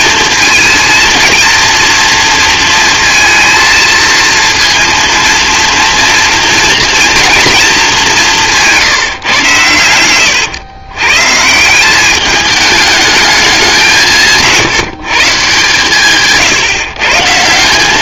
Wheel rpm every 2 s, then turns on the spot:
230, 230, 230, 230, 180, 110, 210, 160, 160.
8-10